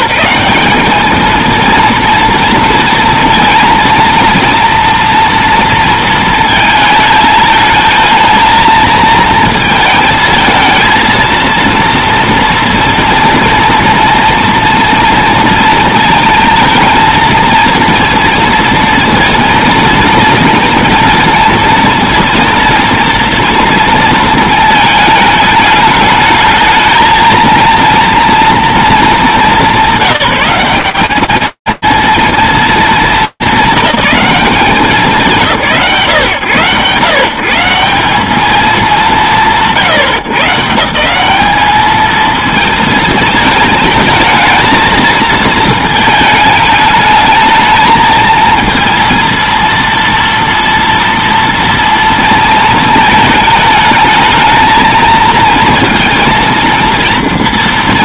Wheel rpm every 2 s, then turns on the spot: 200, 230, 230, 220, 220, 220, 230, 230, 230, 230, 230, 230, 220, 220, 230, 190, 210, 170, 130, 150, 180, 220, 220, 220, 230, 230, 220, 230, 230.
none